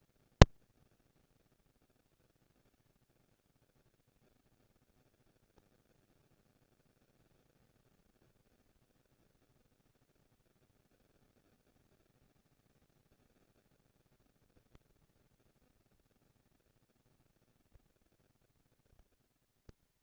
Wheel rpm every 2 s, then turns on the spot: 200, 120, 170, 230, 230, 230, 220, 230, 230, 230.
none